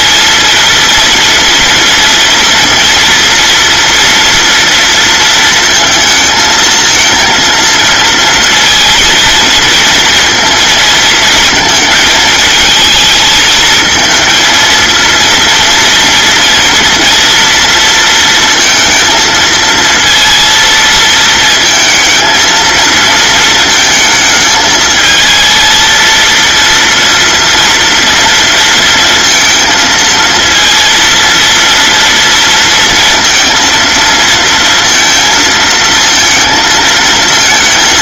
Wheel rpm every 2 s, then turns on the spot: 230, 240, 230, 220, 230, 230, 220, 230, 230, 230, 230, 220, 220, 230, 230, 230, 230, 230, 230.
none